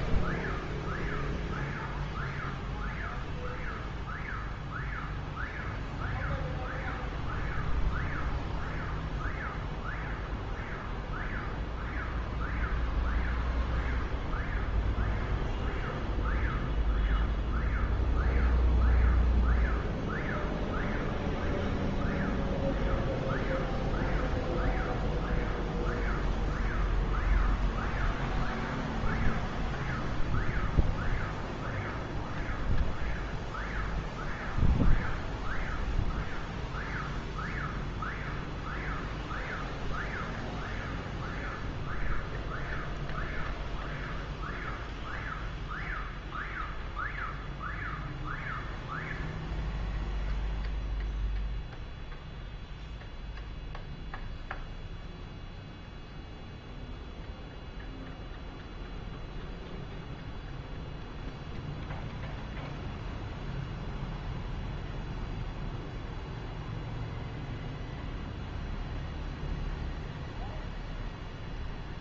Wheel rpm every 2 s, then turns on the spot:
0, 0, 0, 0, 0, 0, 0, 0, 0, 0, 0, 0, 0, 0, 0, 0, 0, 0, 0, 0, 0, 0, 0, 0, 0, 0, 0, 0, 0, 0, 0, 0, 0, 0, 0, 0.
none